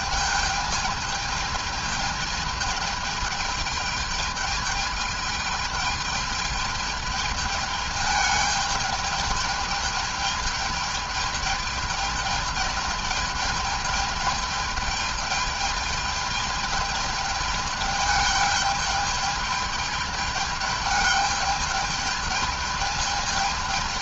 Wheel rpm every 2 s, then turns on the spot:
210, 210, 220, 210, 210, 210, 210, 210, 210, 210, 210, 210.
none